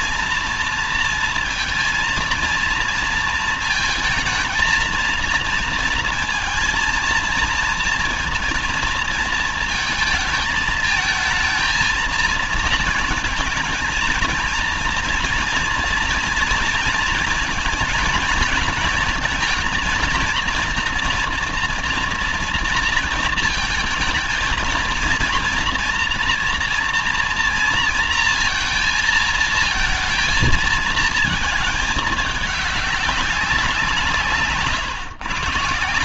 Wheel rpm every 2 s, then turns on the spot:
230, 230, 220, 230, 230, 220, 230, 230, 230, 220, 230, 230, 230, 240, 230, 220, 210, 150.
none